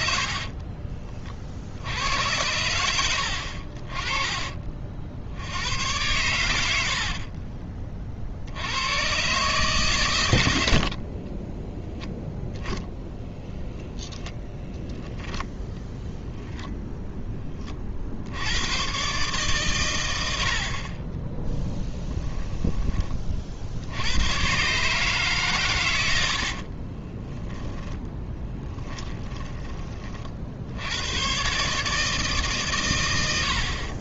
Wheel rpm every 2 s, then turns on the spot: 40, 90, 40, 80, 90, 70, 10, 10, 0, 110, 50, 20, 130, 40, 10, 70, 130.
0-2 12-16 26-30